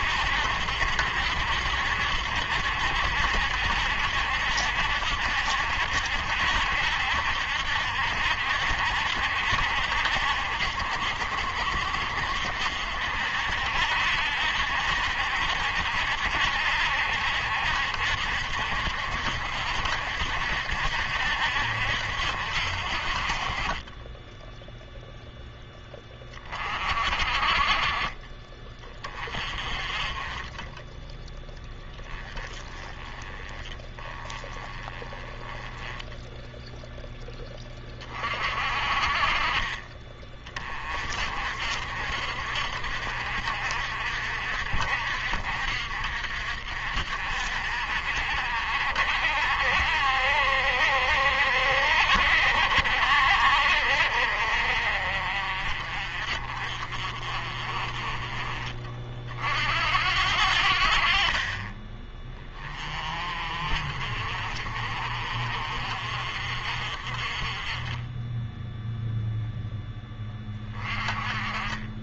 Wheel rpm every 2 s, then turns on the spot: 70, 70, 70, 70, 70, 70, 70, 70, 70, 70, 70, 50, 0, 40, 40, 10, 20, 20, 0, 40, 30, 60, 60, 60, 50, 60, 50, 40, 40, 40, 70, 30, 50, 50, 0, 20.
none